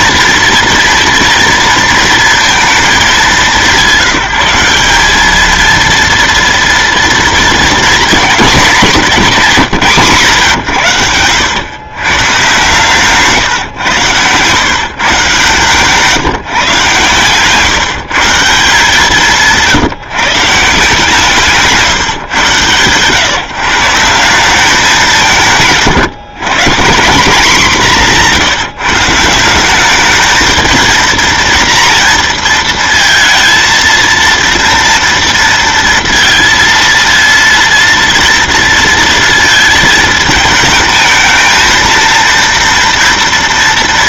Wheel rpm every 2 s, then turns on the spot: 230, 220, 190, 230, 210, 110, 130, 140, 130, 160, 160, 130, 200, 160, 160, 220, 230, 230, 230, 230, 220, 230.
12-14